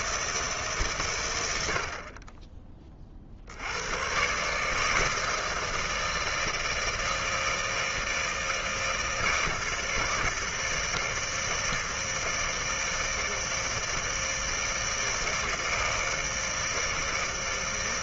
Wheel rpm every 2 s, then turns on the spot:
150, 20, 150, 160, 160, 160, 160, 160, 160.
none